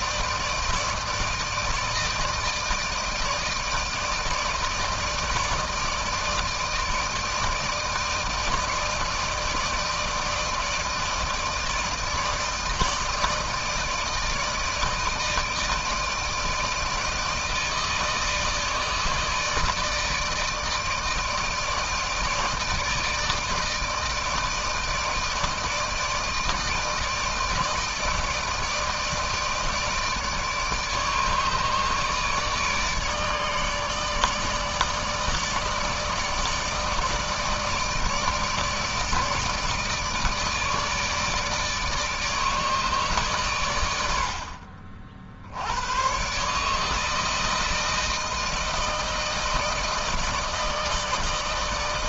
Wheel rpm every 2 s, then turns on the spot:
160, 150, 160, 160, 160, 160, 160, 160, 160, 160, 160, 160, 160, 160, 160, 150, 150, 150, 150, 160, 160, 150, 70, 140, 160, 160.
none